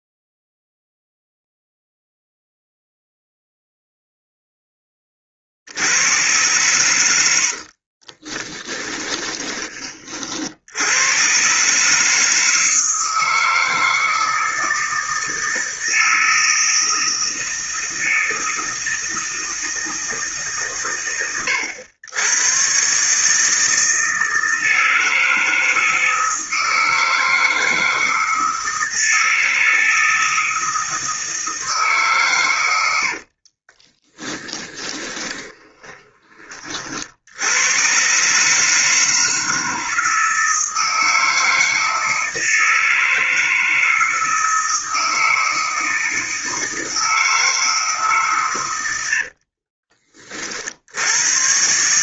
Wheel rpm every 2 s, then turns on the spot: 0, 0, 0, 100, 20, 60, 160, 160, 160, 160, 120, 110, 160, 160, 160, 160, 120, 10, 20, 140, 160, 160, 160, 160, 130, 50.
8-10 34-36